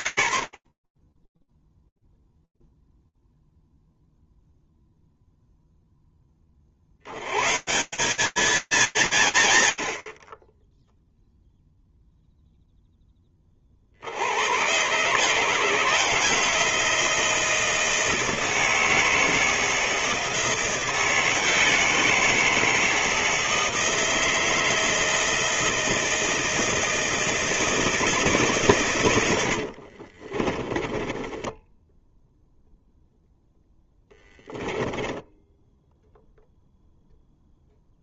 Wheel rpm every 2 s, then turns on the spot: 40, 0, 0, 50, 230, 30, 10, 140, 160, 160, 170, 160, 160, 160, 100, 20, 0, 10, 0.
28-32 34-36